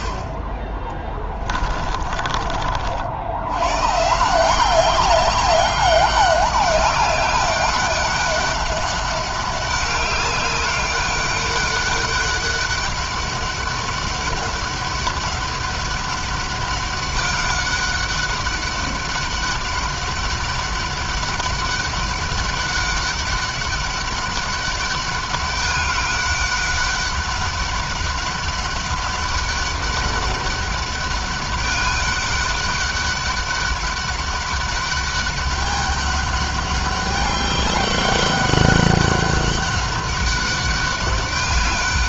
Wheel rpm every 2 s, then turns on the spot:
30, 60, 190, 200, 200, 200, 200, 200, 200, 190, 200, 200, 200, 200, 200, 200, 200, 200, 200, 200, 190.
none